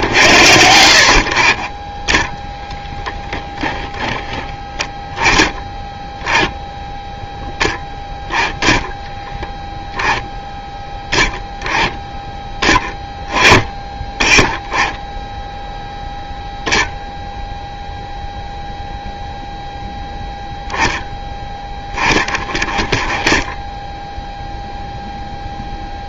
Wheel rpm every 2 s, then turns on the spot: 70, 0, 10, 10, 0, 0, 10, 10, 0, 0, 0, 20, 0.
none